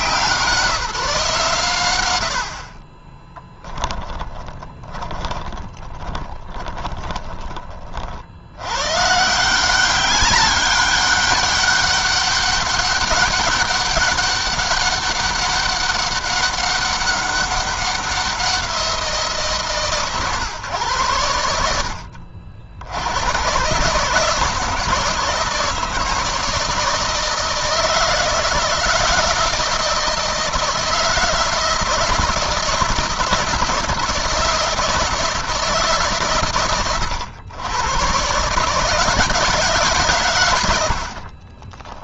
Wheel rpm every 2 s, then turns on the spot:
150, 20, 20, 20, 130, 200, 200, 200, 200, 170, 110, 90, 160, 160, 160, 160, 160, 160, 100, 160, 60.
2-8 40-42